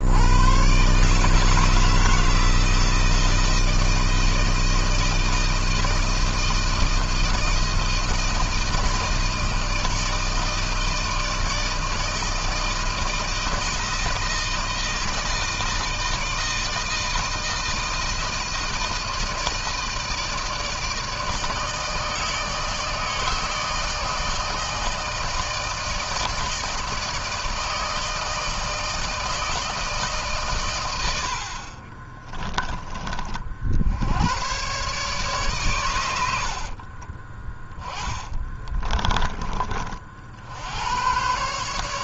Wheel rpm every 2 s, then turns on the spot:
90, 160, 160, 160, 160, 160, 160, 160, 160, 160, 160, 150, 160, 160, 160, 140, 20, 100, 80, 20, 70.
32-34 38-40